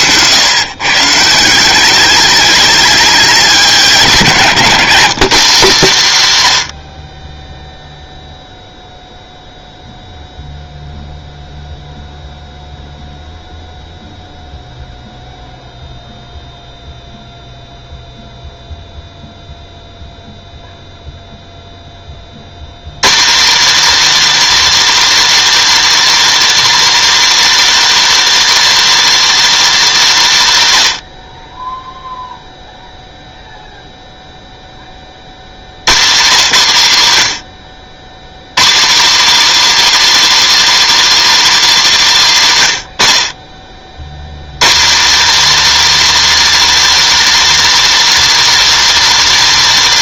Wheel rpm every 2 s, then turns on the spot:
140, 210, 190, 100, 0, 0, 0, 0, 0, 0, 0, 120, 320, 320, 320, 170, 0, 20, 160, 180, 320, 150, 180, 320, 320.
4-6